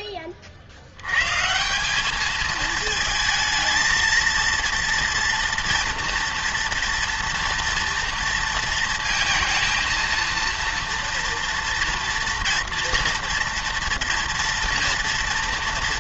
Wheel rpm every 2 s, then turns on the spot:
60, 220, 230, 230, 230, 230, 230, 230.
none